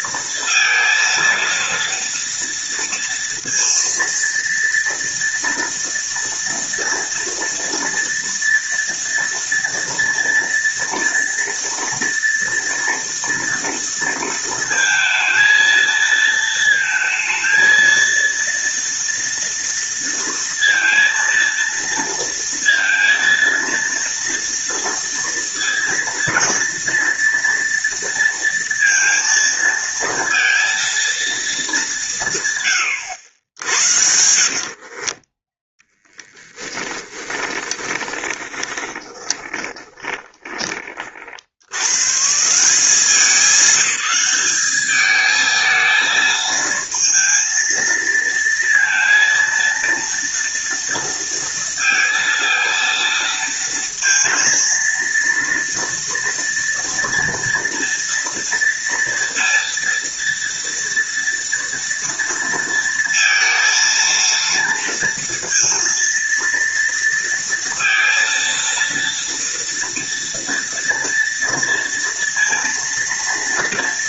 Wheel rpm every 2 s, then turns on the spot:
230, 230, 230, 230, 230, 230, 230, 230, 230, 230, 230, 230, 230, 230, 230, 230, 110, 40, 10, 20, 40, 190, 210, 230, 230, 230, 230, 230, 230, 230, 230, 230, 230, 230, 230, 230, 230.
34-40